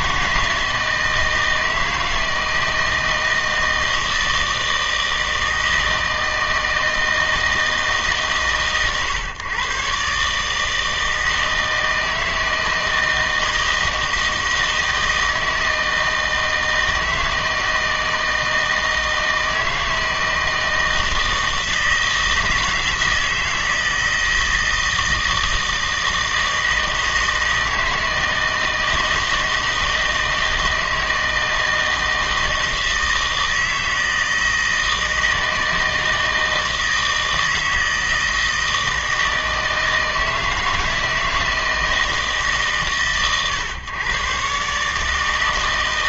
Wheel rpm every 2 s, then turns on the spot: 160, 160, 160, 160, 120, 150, 160, 160, 160, 160, 160, 160, 160, 160, 160, 160, 160, 160, 160, 160, 160, 150, 130.
none